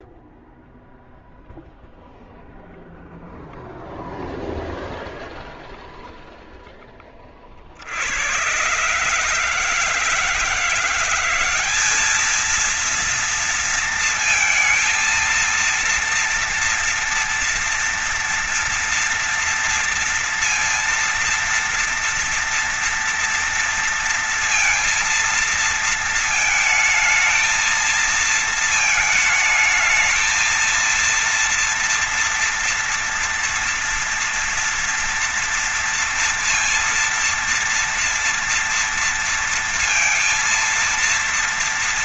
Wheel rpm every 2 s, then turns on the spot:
0, 0, 0, 0, 90, 160, 210, 230, 230, 230, 230, 230, 230, 220, 220, 230, 230, 230, 230, 230, 230.
none